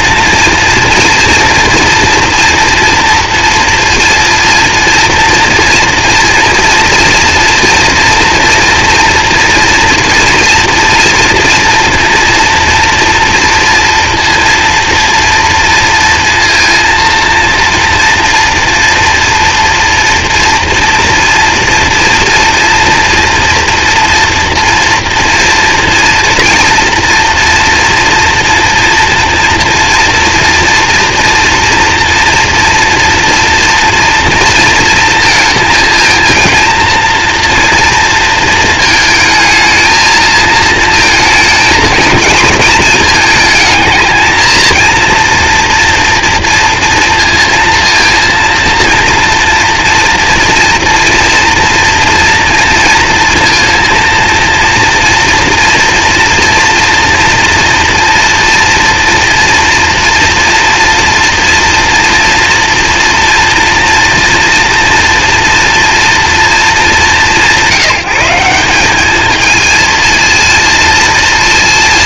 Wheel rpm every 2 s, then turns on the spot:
230, 240, 230, 230, 240, 230, 230, 230, 230, 230, 240, 240, 230, 230, 230, 230, 240, 230, 230, 230, 230, 230, 230, 230, 230, 230, 230, 230, 230, 230, 230, 230, 230, 220, 180, 230.
none